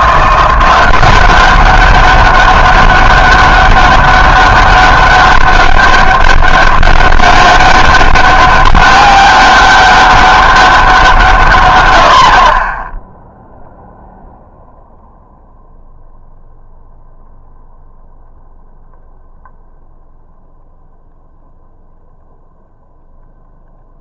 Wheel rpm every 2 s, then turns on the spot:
180, 200, 200, 200, 200, 190, 20, 0, 0, 0, 0, 0.
none